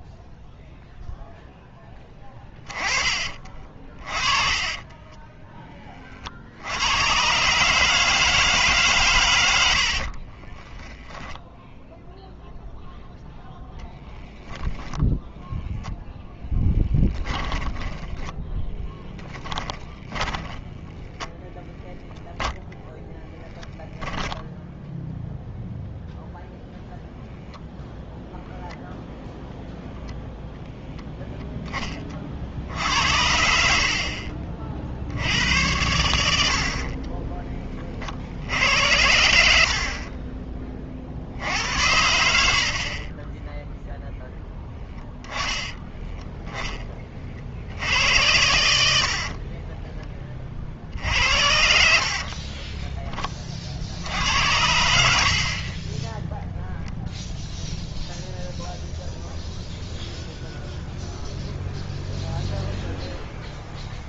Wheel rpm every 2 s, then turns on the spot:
0, 20, 20, 80, 150, 20, 0, 10, 10, 10, 10, 0, 10, 0, 10, 0, 60, 30, 70, 90, 20, 50, 10, 10, 70, 50, 20, 80, 0, 0, 0, 0.
10-12 14-22 50-54